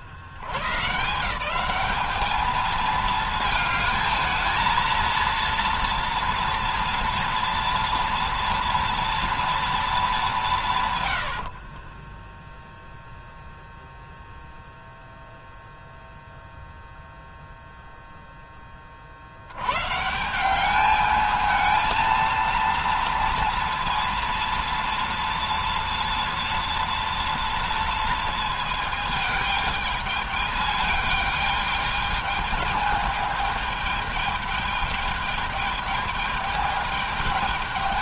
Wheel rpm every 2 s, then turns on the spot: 120, 220, 220, 230, 230, 190, 10, 0, 0, 10, 180, 230, 230, 230, 230, 210, 210, 210, 210.
12-14